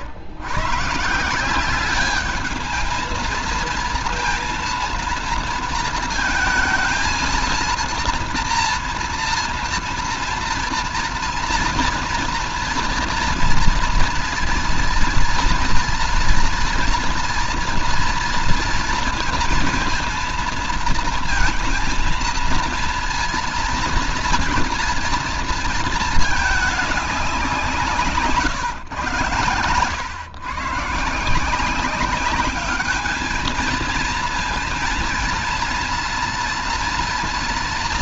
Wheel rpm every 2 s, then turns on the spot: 110, 210, 230, 230, 240, 230, 230, 230, 240, 230, 230, 230, 230, 210, 140, 130, 200, 230, 230.
none